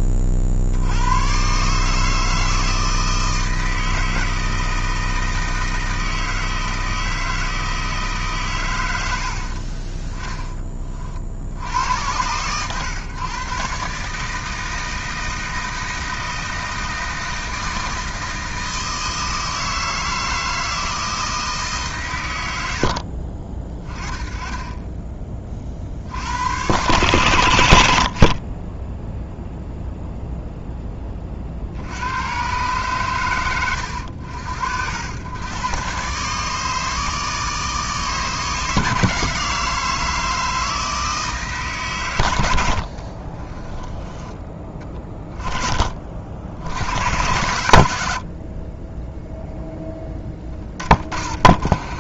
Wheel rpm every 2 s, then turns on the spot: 60, 160, 160, 160, 120, 30, 120, 160, 160, 160, 160, 80, 20, 120, 20, 10, 120, 80, 150, 150, 160, 80, 20, 80, 30, 20.
22-24 42-44